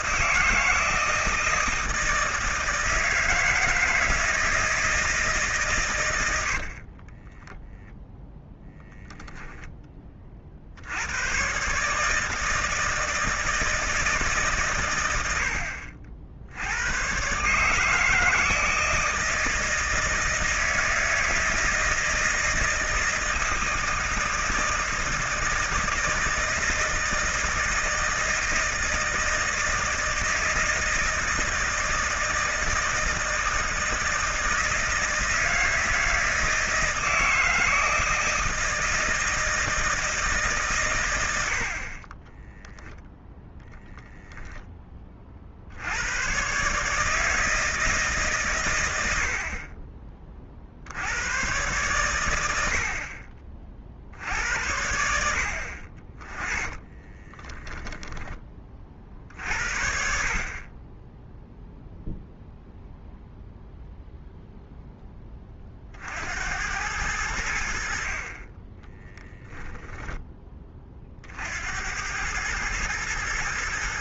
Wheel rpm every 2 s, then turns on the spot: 160, 160, 160, 30, 0, 90, 160, 100, 110, 160, 160, 160, 160, 160, 160, 160, 160, 160, 160, 160, 110, 0, 30, 150, 90, 70, 70, 80, 20, 40, 20, 0, 10, 90, 20, 40, 110.
6-8 56-58 68-70